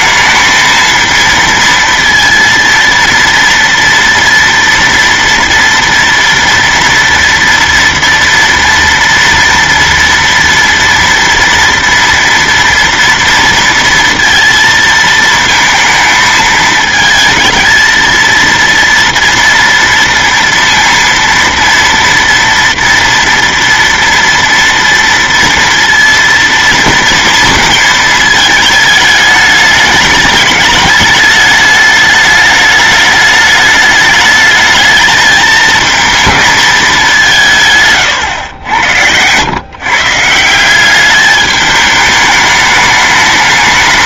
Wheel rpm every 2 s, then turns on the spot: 230, 230, 230, 230, 230, 230, 230, 230, 220, 230, 230, 230, 230, 230, 220, 210, 210, 220, 200, 90, 200, 210.
none